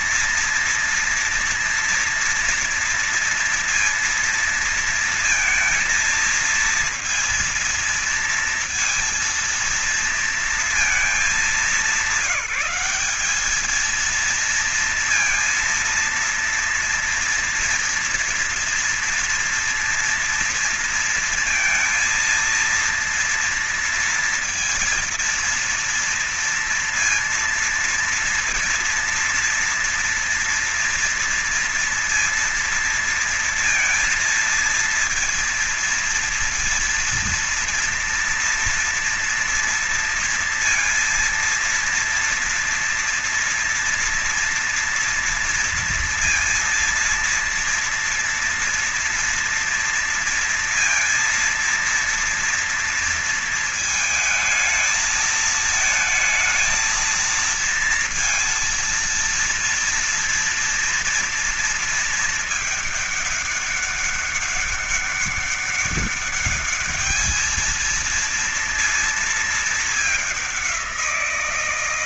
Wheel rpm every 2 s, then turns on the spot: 230, 230, 230, 230, 230, 200, 210, 230, 230, 230, 230, 230, 240, 230, 230, 230, 230, 230, 230, 230, 230, 230, 230, 230, 230, 230, 230, 220, 230, 230, 230, 210, 200, 220, 220, 180.
none